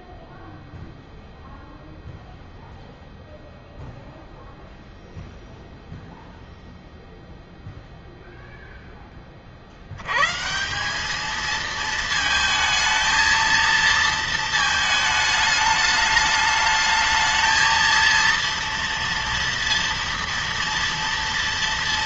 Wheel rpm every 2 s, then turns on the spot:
0, 0, 0, 0, 0, 170, 220, 220, 210, 230, 230.
none